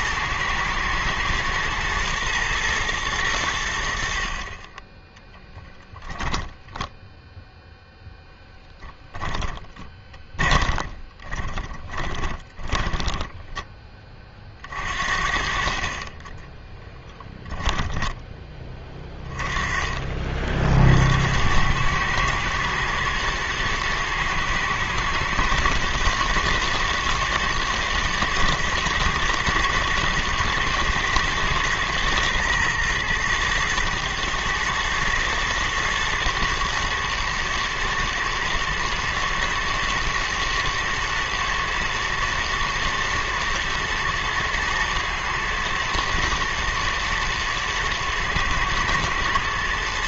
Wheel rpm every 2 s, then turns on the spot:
120, 80, 10, 0, 10, 20, 10, 50, 10, 20, 90, 110, 110, 120, 120, 110, 110, 110, 120, 110, 120, 120, 110, 120, 110.
8-14 16-18